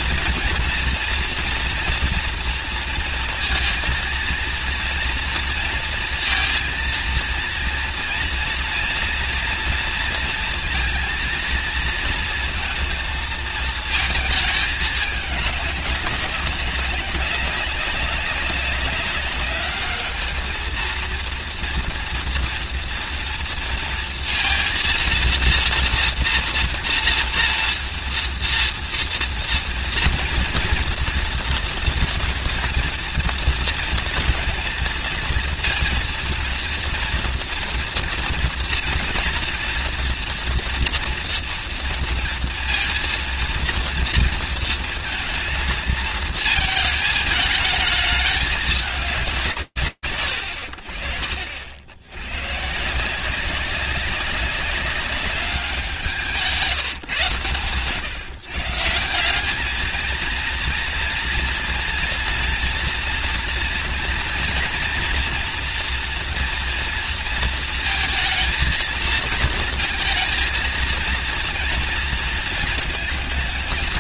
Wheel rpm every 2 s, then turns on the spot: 230, 230, 230, 230, 230, 230, 230, 220, 200, 200, 220, 230, 230, 240, 240, 230, 230, 220, 230, 240, 230, 230, 230, 220, 220, 60, 140, 190, 170, 150, 230, 230, 230, 240, 230, 230, 230.
none